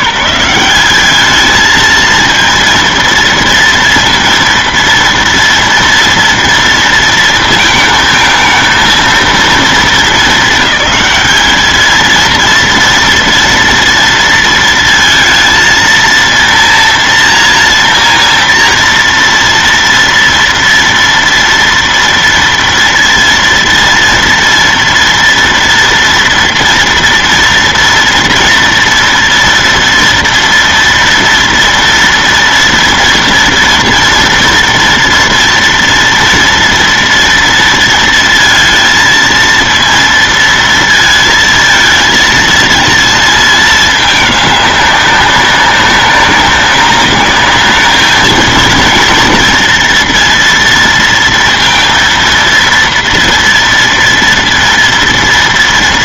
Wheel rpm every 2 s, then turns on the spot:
190, 230, 230, 230, 220, 220, 230, 230, 230, 230, 230, 230, 230, 230, 230, 230, 230, 230, 230, 230, 230, 220, 210, 200, 220, 230, 230, 230.
none